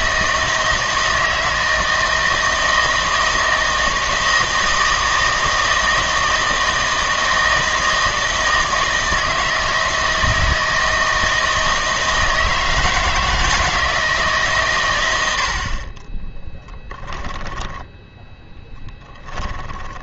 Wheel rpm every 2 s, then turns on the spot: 160, 160, 160, 160, 160, 160, 160, 130, 10, 20.
16-20